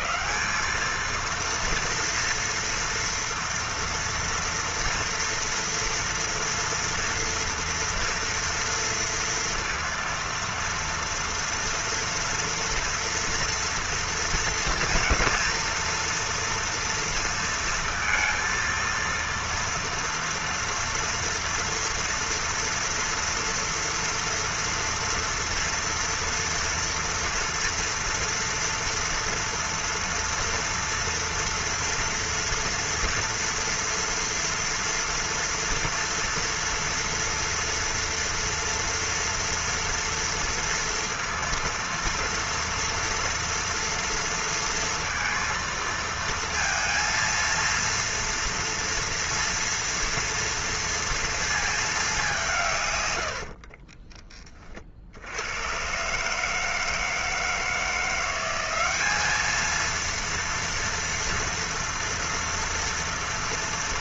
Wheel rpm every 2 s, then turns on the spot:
200, 230, 230, 230, 230, 230, 230, 230, 240, 230, 230, 230, 230, 230, 230, 230, 230, 230, 230, 230, 230, 230, 230, 230, 230, 230, 170, 40, 150, 190, 230, 230.
none